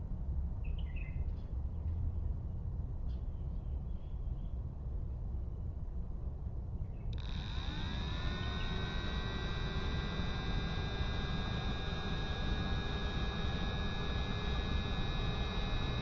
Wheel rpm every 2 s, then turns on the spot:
0, 0, 0, 0, 0, 0, 0, 0.
none